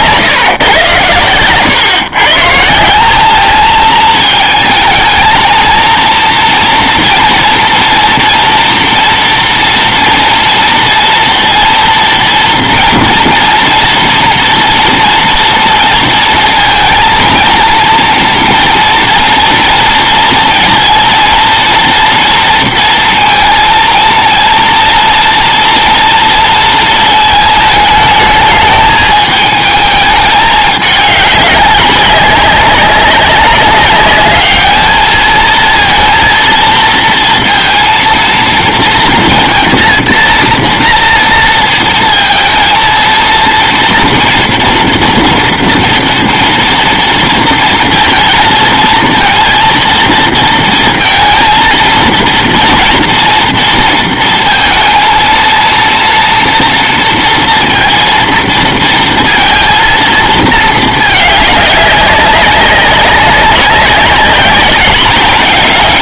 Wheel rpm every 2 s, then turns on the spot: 140, 150, 220, 230, 230, 230, 230, 230, 230, 230, 230, 230, 230, 230, 220, 210, 190, 210, 230, 230, 230, 230, 240, 230, 230, 230, 230, 230, 230, 230, 220, 200, 200.
none